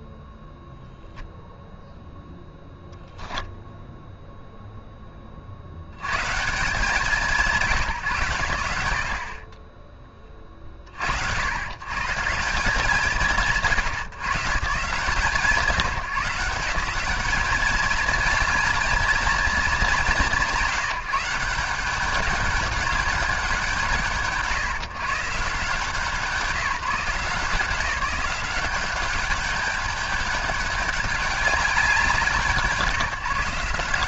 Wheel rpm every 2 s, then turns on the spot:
0, 0, 30, 180, 60, 70, 150, 170, 190, 220, 160, 210, 150, 170, 190, 200, 170.
none